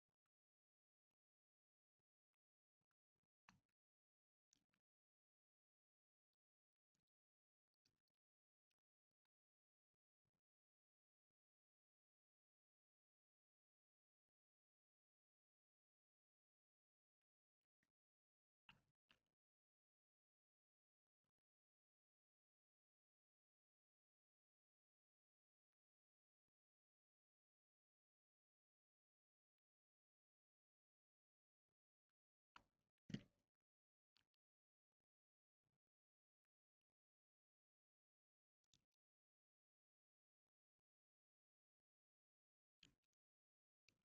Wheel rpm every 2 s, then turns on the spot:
0, 0, 0, 0, 0, 0, 0, 0, 0, 0, 0, 0, 0, 0, 0, 0, 0, 0, 0, 0, 0, 0.
none